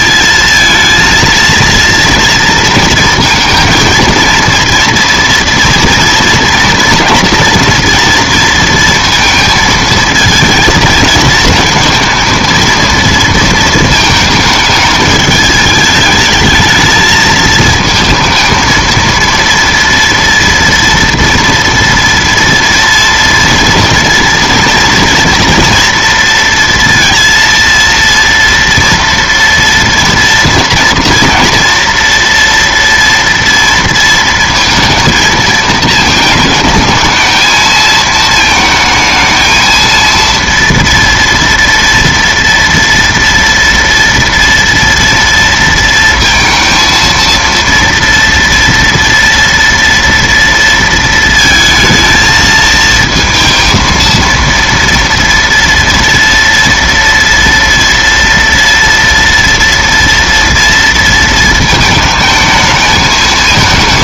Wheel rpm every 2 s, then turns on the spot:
230, 230, 230, 230, 230, 220, 230, 220, 220, 230, 230, 240, 230, 230, 230, 240, 230, 230, 220, 220, 230, 230, 230, 230, 230, 230, 220, 230, 230, 230, 230, 220.
none